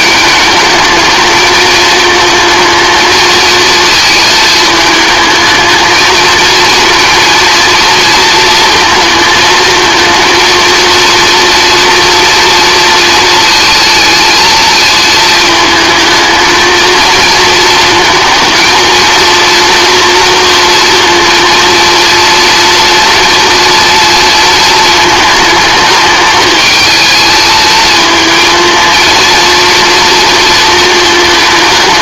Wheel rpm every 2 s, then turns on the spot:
220, 220, 220, 230, 230, 230, 230, 230, 220, 230, 230, 230, 230, 210, 220, 230.
none